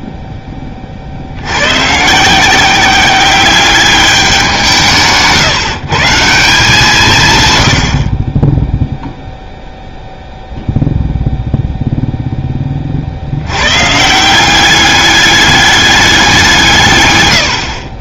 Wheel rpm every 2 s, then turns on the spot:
20, 170, 180, 170, 20, 0, 20, 180, 170.
none